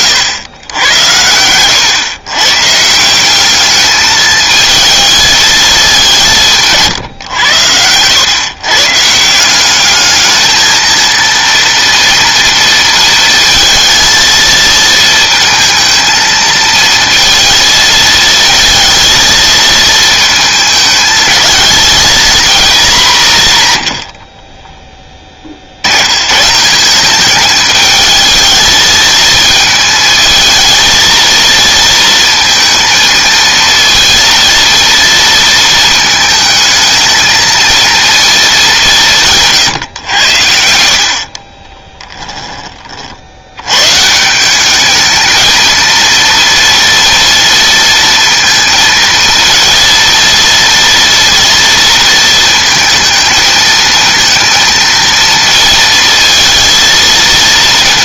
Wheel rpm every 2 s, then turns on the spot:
100, 140, 220, 140, 150, 220, 230, 220, 230, 230, 220, 220, 20, 180, 220, 230, 230, 230, 220, 200, 70, 30, 200, 230, 230, 230, 230, 230, 230.
24-26